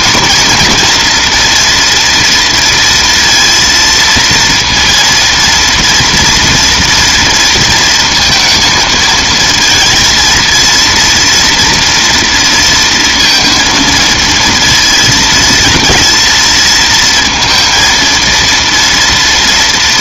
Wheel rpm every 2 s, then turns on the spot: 230, 230, 230, 230, 230, 230, 230, 230, 220, 230.
none